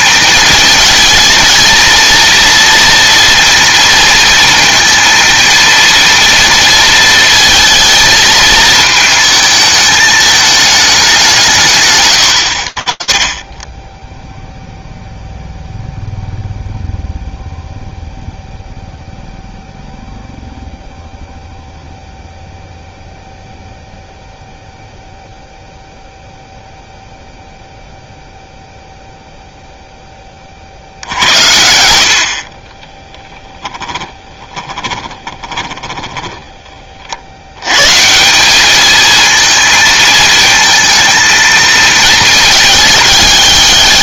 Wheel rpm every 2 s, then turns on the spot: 220, 230, 230, 230, 220, 220, 70, 0, 0, 0, 0, 0, 0, 0, 0, 70, 10, 20, 60, 220, 220, 220.
32-36